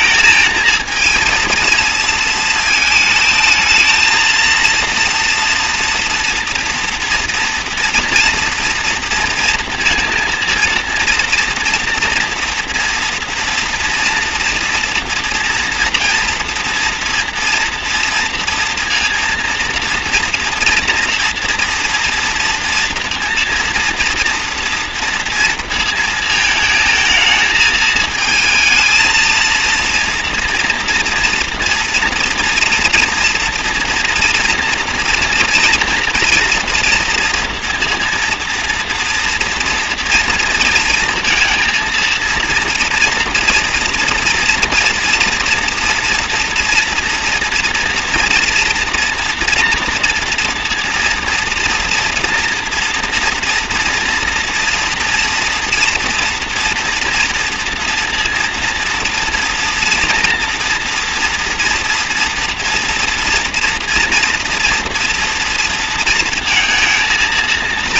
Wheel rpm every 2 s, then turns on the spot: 220, 220, 230, 230, 230, 230, 230, 230, 230, 230, 230, 230, 230, 220, 220, 240, 240, 230, 230, 240, 230, 230, 230, 240, 230, 230, 230, 230, 230, 230, 240, 230, 230, 230.
none